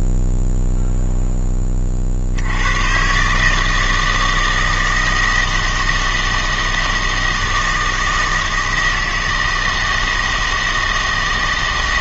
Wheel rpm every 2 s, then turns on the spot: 0, 120, 160, 160, 160, 160.
none